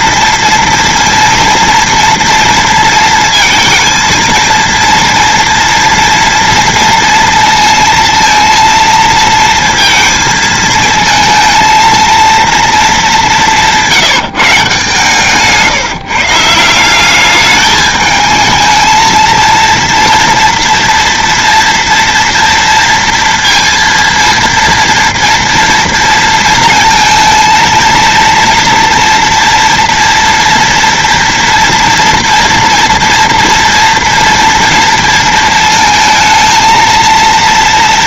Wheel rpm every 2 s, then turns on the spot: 230, 230, 230, 230, 220, 220, 210, 140, 200, 220, 230, 230, 230, 230, 240, 230, 230, 230, 230.
none